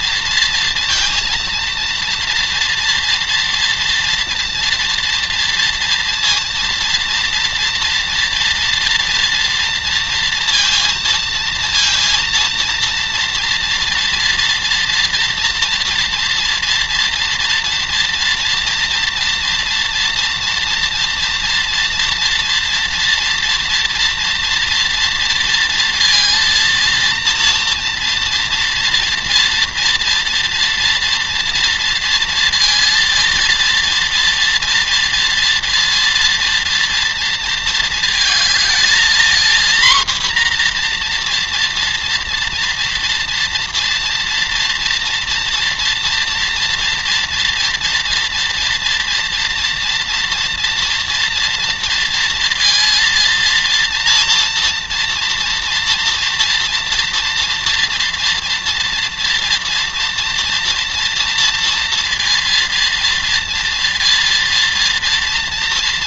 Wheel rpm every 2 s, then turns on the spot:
230, 230, 230, 230, 230, 230, 230, 230, 230, 230, 230, 230, 230, 230, 230, 230, 230, 230, 230, 230, 240, 230, 240, 240, 240, 240, 230, 230, 240, 240, 230, 230, 230.
none